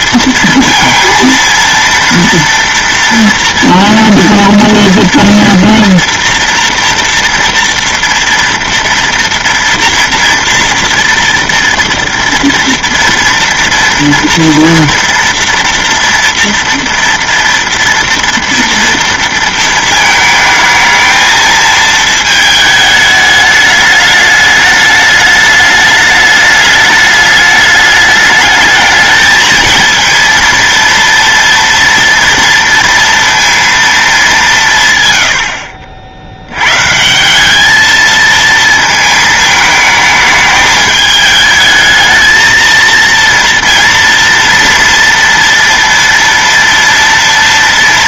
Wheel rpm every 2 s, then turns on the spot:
230, 230, 240, 230, 230, 230, 230, 230, 230, 230, 220, 220, 210, 210, 210, 230, 230, 160, 110, 220, 210, 220, 230, 230.
none